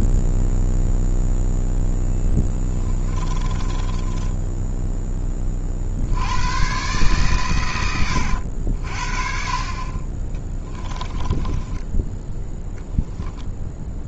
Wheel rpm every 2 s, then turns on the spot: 0, 20, 10, 130, 50, 10, 10.
2-4 10-12